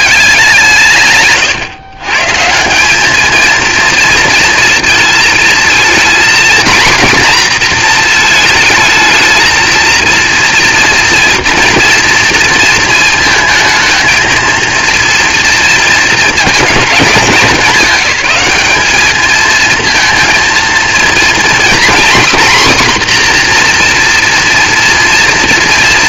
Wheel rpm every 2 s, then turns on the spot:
170, 180, 230, 240, 220, 230, 230, 230, 230, 200, 230, 260, 230.
none